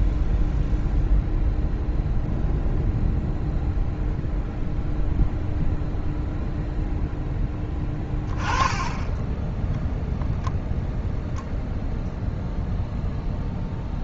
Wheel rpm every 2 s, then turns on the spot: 0, 0, 0, 0, 20, 0, 0.
none